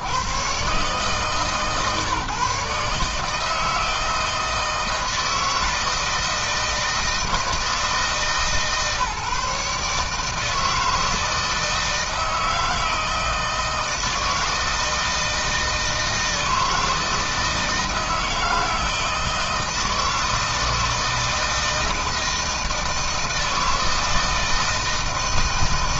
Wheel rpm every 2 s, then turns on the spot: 130, 140, 160, 160, 140, 150, 160, 160, 160, 160, 160, 160, 160.
none